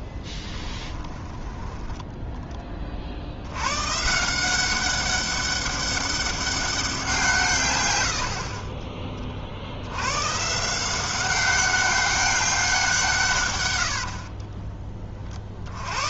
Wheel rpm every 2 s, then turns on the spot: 10, 30, 190, 190, 30, 160, 180, 20.
0-2 8-10